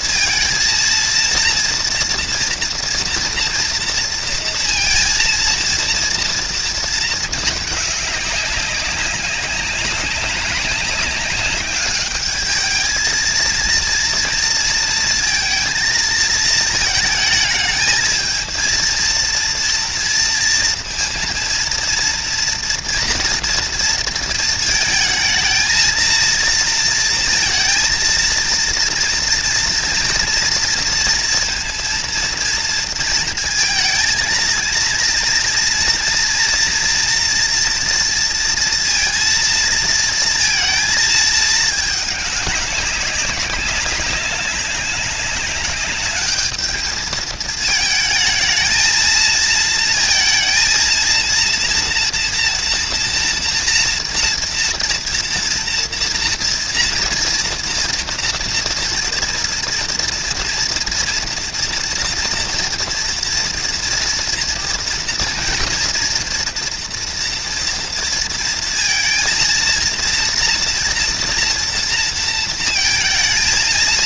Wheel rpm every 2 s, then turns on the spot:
230, 230, 230, 230, 200, 200, 210, 230, 220, 220, 230, 230, 220, 230, 230, 230, 230, 230, 230, 230, 230, 200, 200, 210, 230, 230, 230, 230, 230, 230, 230, 230, 240, 240, 230, 230, 230.
none